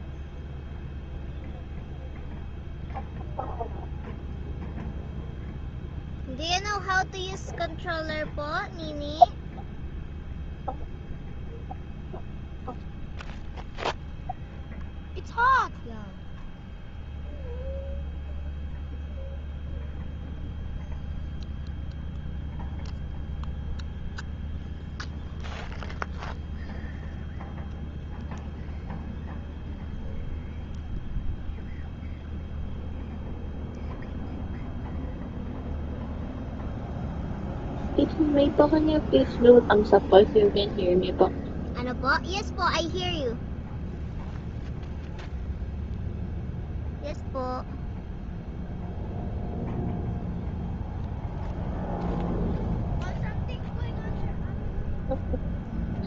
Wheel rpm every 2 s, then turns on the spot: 0, 0, 0, 0, 0, 0, 0, 0, 0, 0, 0, 0, 0, 0, 0, 0, 0, 0, 0, 0, 0, 0, 0, 0, 0, 0, 0, 0.
none